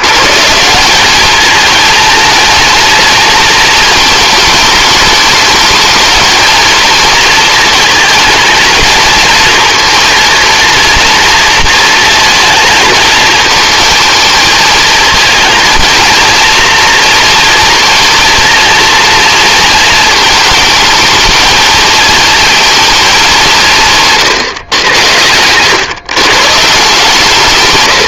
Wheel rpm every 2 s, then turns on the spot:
180, 230, 210, 230, 230, 230, 220, 220, 230, 230, 220, 220, 110, 160.
none